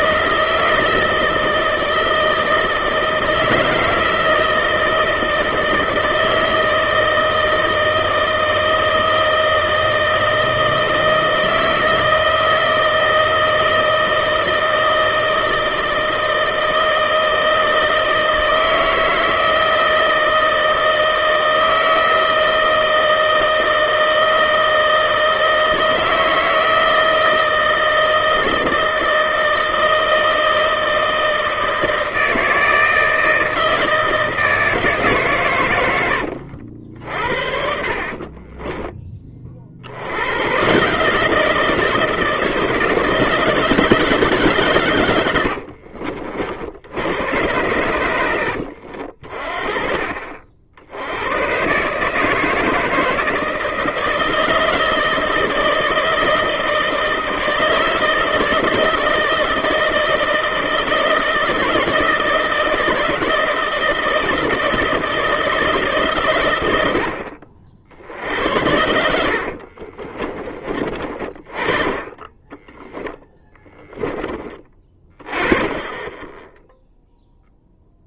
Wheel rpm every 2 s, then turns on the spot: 160, 160, 160, 160, 160, 160, 160, 160, 160, 160, 160, 160, 160, 160, 160, 160, 160, 160, 70, 30, 140, 170, 130, 70, 70, 70, 160, 160, 160, 160, 160, 160, 160, 80, 80, 30, 20, 20, 0.
38-40 72-74